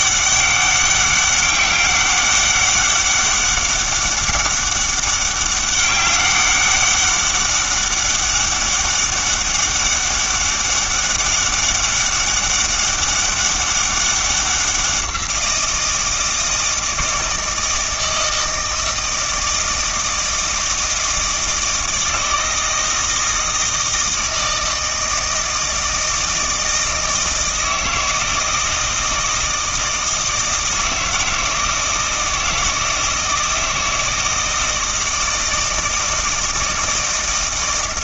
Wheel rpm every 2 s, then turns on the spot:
200, 200, 200, 200, 200, 200, 200, 190, 160, 160, 160, 160, 160, 160, 160, 160, 160, 160, 160.
none